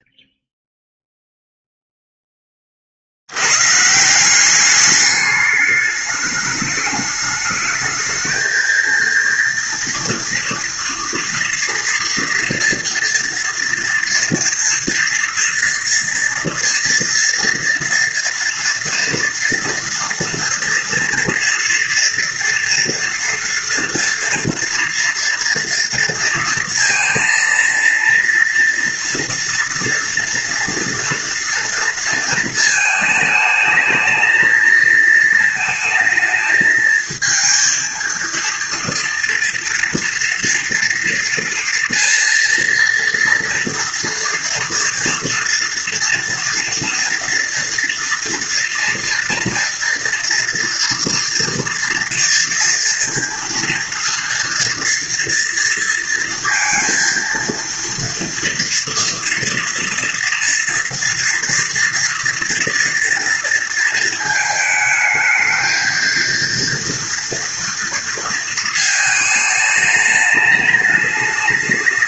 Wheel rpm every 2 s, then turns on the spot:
0, 40, 200, 210, 230, 230, 230, 240, 230, 230, 230, 230, 230, 230, 230, 230, 220, 220, 220, 230, 230, 230, 230, 230, 230, 230, 230, 230, 230, 230, 240, 240, 220, 230, 220, 210.
none